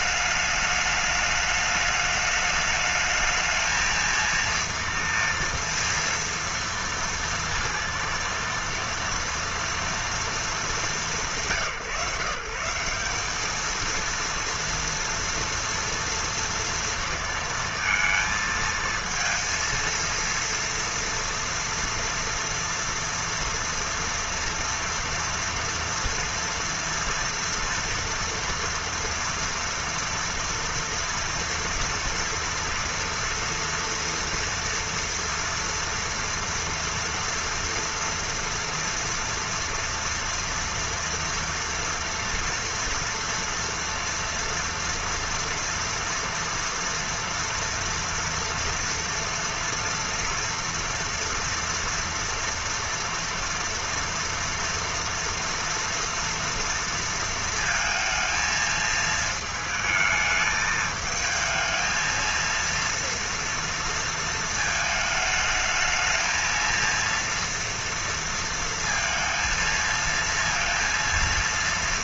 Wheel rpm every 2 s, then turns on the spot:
210, 210, 230, 230, 230, 230, 170, 230, 230, 220, 230, 230, 240, 230, 230, 230, 230, 230, 230, 230, 230, 230, 230, 230, 230, 230, 230, 230, 230, 220, 220, 230, 220, 230, 230, 230.
none